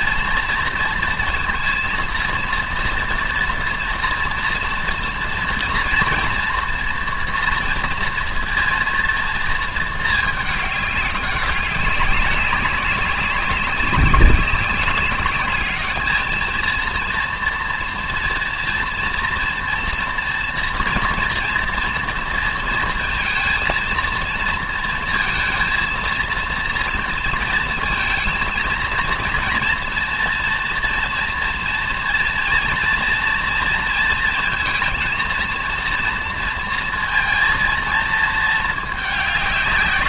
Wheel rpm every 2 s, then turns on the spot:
230, 230, 230, 230, 230, 210, 200, 190, 230, 230, 230, 230, 230, 230, 220, 230, 230, 230, 230, 220.
none